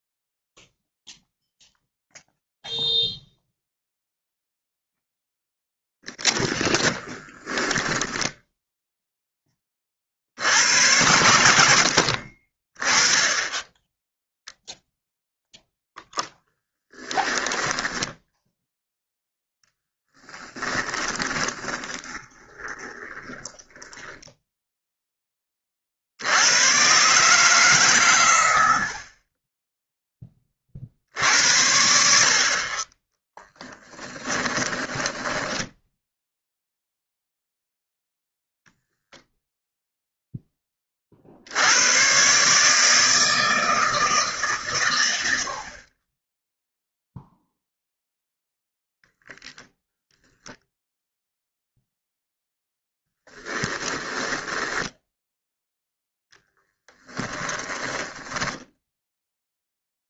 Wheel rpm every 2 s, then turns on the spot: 0, 0, 0, 20, 0, 90, 20, 0, 10, 0, 10, 10, 0, 120, 70, 50, 30, 10, 0, 0, 20, 160, 120, 0, 0, 10, 0, 10, 10, 0.
6-8 20-24 34-36 54-58